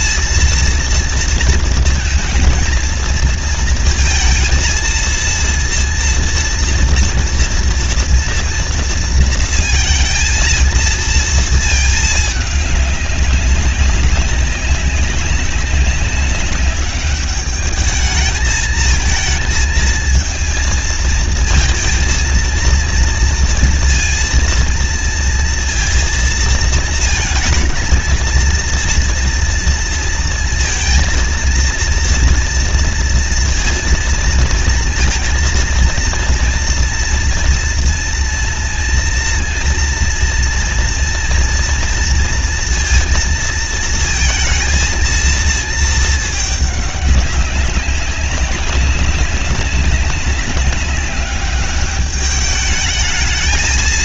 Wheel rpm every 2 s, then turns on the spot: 230, 220, 230, 230, 230, 220, 210, 190, 200, 220, 230, 230, 230, 230, 230, 230, 230, 230, 230, 230, 230, 230, 230, 210, 200, 200, 210.
none